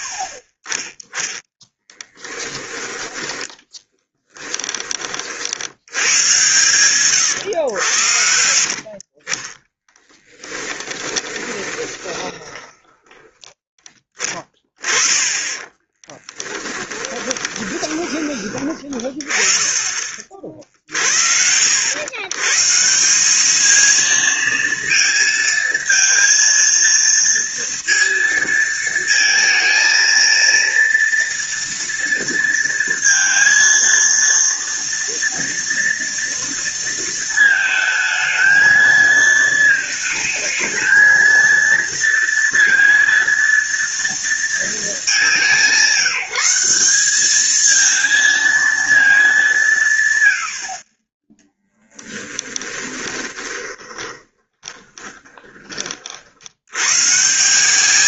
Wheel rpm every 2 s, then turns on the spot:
50, 10, 20, 120, 50, 20, 20, 20, 20, 20, 50, 150, 230, 230, 220, 230, 230, 230, 230, 220, 220, 230, 220, 190, 220, 40, 10, 20, 100.
8-14 16-18 52-56